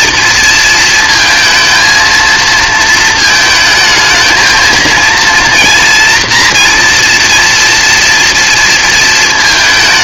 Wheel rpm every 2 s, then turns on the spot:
230, 220, 220, 240, 230.
none